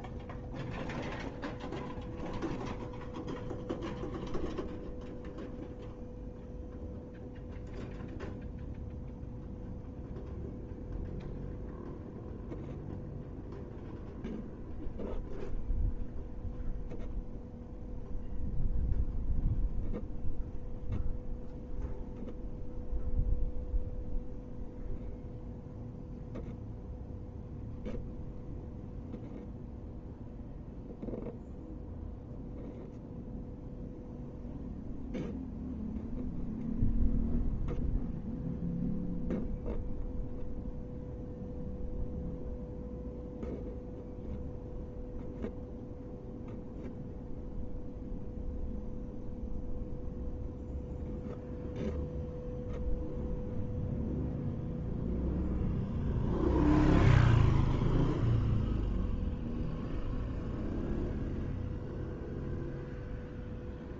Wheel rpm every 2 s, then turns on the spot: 0, 0, 0, 0, 0, 0, 0, 0, 0, 0, 0, 0, 0, 0, 0, 0, 0, 0, 0, 0, 0, 0, 0, 0, 0, 0, 0, 0, 0, 0, 0, 0.
none